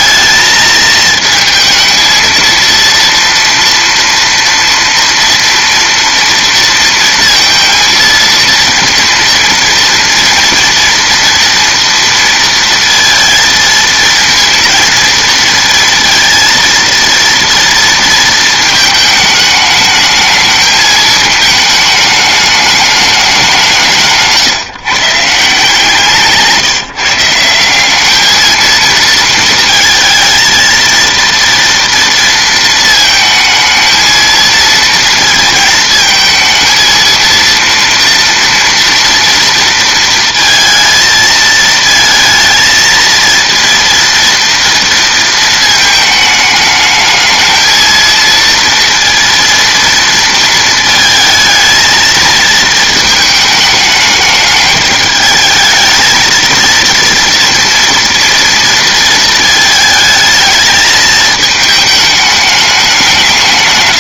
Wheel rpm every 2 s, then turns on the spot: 220, 230, 230, 230, 230, 230, 230, 230, 230, 220, 220, 210, 140, 160, 220, 230, 230, 230, 220, 230, 230, 220, 230, 220, 230, 220, 230, 210, 230, 230, 220, 210.
none